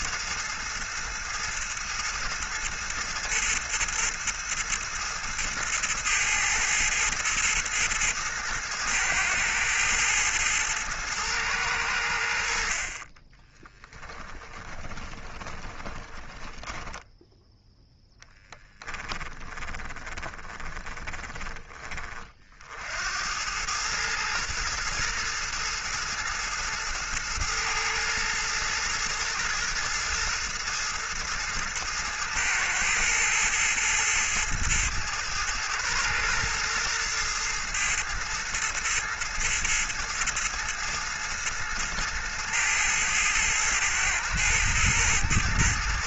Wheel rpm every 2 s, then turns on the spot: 110, 110, 110, 110, 110, 110, 60, 20, 10, 10, 20, 60, 110, 110, 110, 110, 110, 110, 120, 110, 110, 110, 110.
14-22